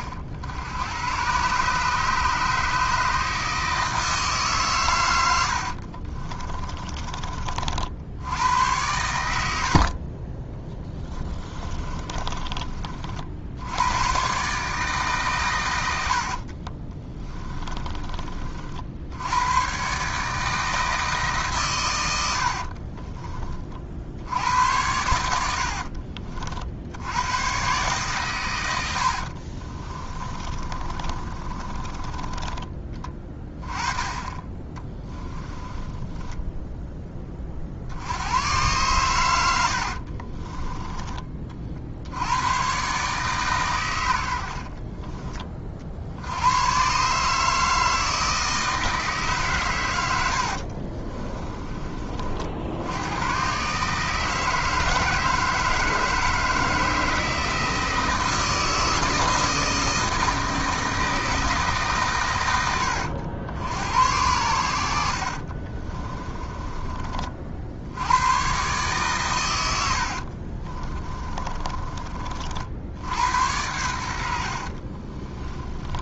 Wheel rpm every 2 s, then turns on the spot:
90, 150, 130, 30, 100, 10, 50, 150, 30, 50, 160, 50, 90, 70, 90, 30, 20, 20, 10, 110, 20, 130, 40, 120, 160, 50, 80, 160, 160, 160, 160, 90, 80, 30, 130, 30, 70, 50.
6-8 10-12 16-18 22-24 28-32 34-36 40-42 44-46 50-52 70-72 74-76